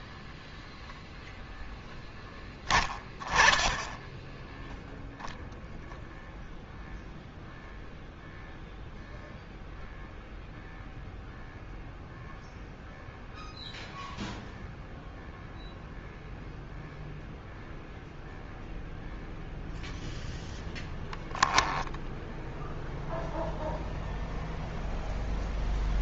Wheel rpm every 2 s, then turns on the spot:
0, 20, 10, 0, 0, 0, 0, 0, 0, 0, 0, 0, 0.
none